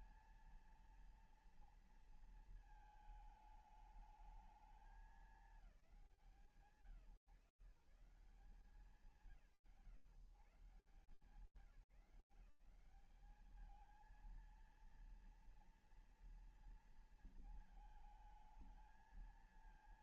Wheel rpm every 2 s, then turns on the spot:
230, 230, 210, 160, 160, 150, 190, 230, 230, 220.
none